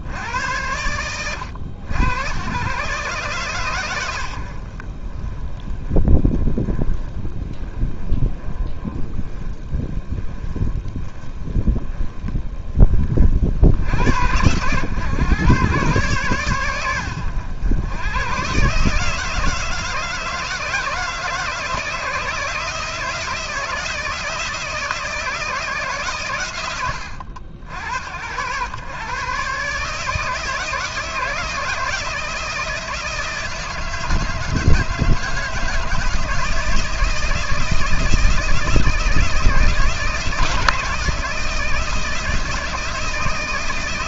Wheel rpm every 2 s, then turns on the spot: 90, 130, 30, 20, 20, 20, 50, 120, 100, 160, 160, 160, 130, 70, 140, 160, 160, 160, 160, 160, 160, 170.
none